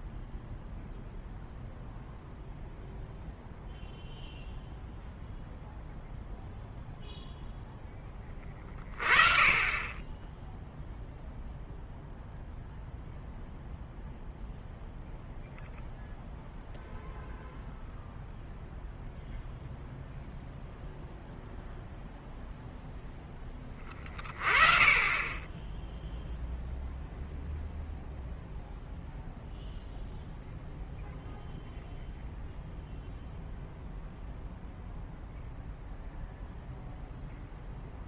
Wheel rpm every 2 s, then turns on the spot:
0, 0, 0, 0, 30, 0, 0, 0, 0, 0, 0, 0, 30, 0, 0, 0, 0, 0, 0.
none